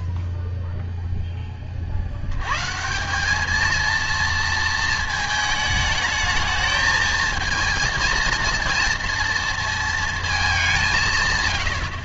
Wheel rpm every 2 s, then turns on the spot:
0, 110, 230, 220, 230, 220.
none